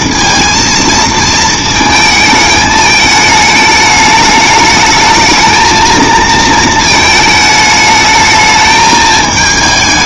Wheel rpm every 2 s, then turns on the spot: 230, 220, 210, 220, 220.
none